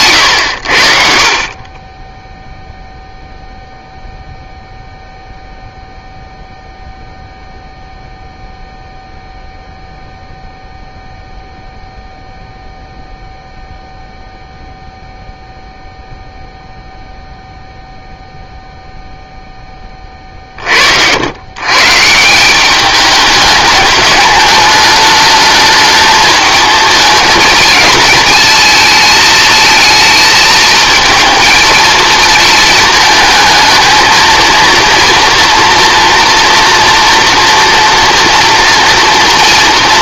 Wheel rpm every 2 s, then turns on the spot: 70, 0, 0, 0, 0, 0, 0, 0, 0, 0, 60, 200, 210, 220, 220, 220, 220, 230, 230, 230.
none